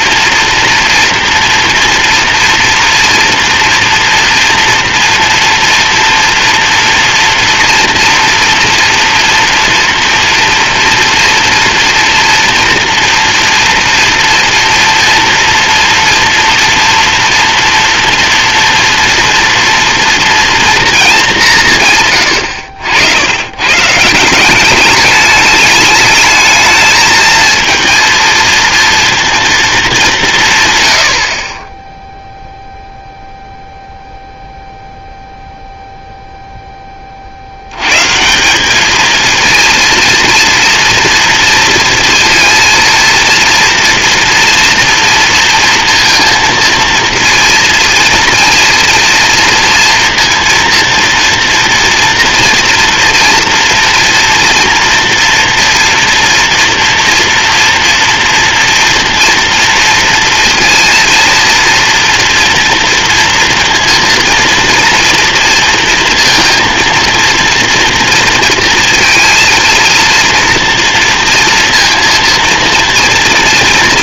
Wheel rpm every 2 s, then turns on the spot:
230, 230, 230, 240, 240, 230, 230, 230, 230, 230, 210, 100, 200, 220, 230, 50, 0, 0, 70, 230, 230, 230, 230, 230, 230, 230, 230, 240, 230, 230, 230, 230, 230, 230, 230, 230, 230.
none